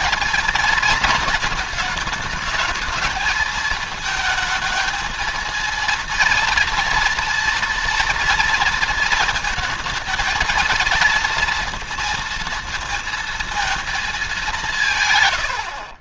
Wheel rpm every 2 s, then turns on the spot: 220, 220, 220, 230, 230, 220, 230, 160.
none